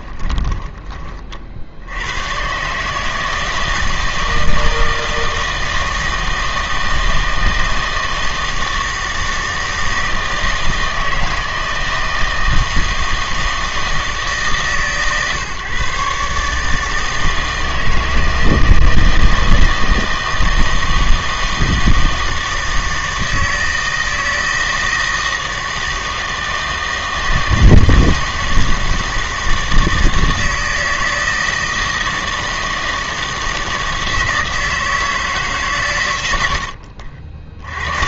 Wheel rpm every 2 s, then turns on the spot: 20, 140, 160, 160, 160, 160, 160, 150, 150, 160, 160, 160, 160, 160, 160, 160, 160, 160, 80.
0-2